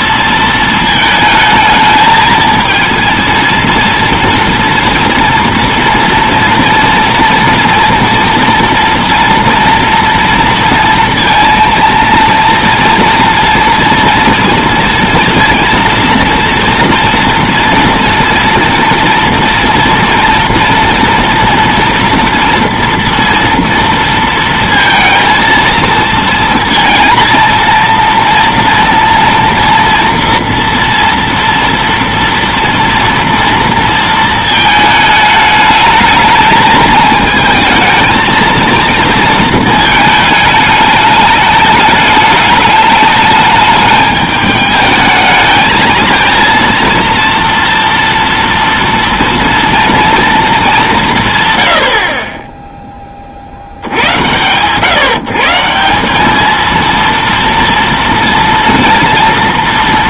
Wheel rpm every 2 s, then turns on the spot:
220, 230, 230, 230, 230, 230, 230, 230, 230, 230, 230, 230, 230, 230, 230, 230, 230, 220, 220, 220, 210, 210, 220, 230, 230, 110, 70, 160, 230, 230.
none